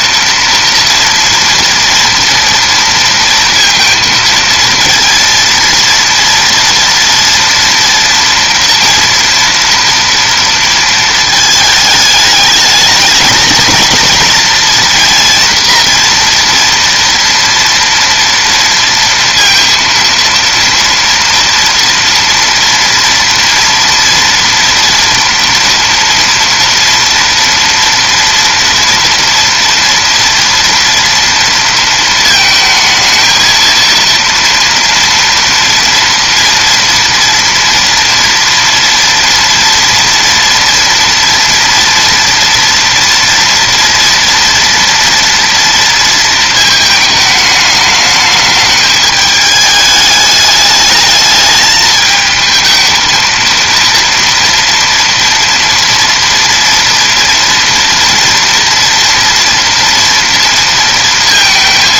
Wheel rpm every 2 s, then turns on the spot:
230, 230, 230, 230, 230, 230, 220, 230, 230, 230, 230, 230, 240, 230, 230, 230, 220, 230, 230, 230, 230, 230, 230, 220, 210, 210, 220, 230, 230, 230, 230.
none